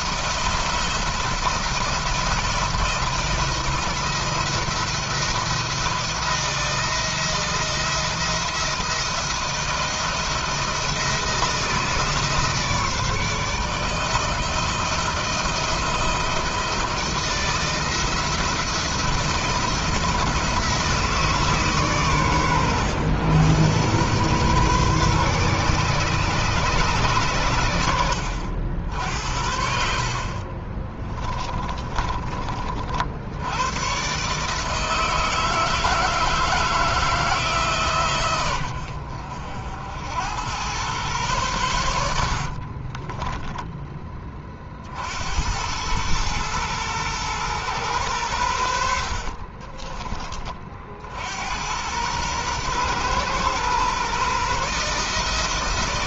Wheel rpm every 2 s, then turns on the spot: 170, 170, 170, 170, 170, 170, 150, 160, 160, 170, 160, 110, 130, 120, 60, 20, 60, 160, 160, 80, 110, 40, 60, 120, 60, 70, 120, 150.
30-32 42-44 48-50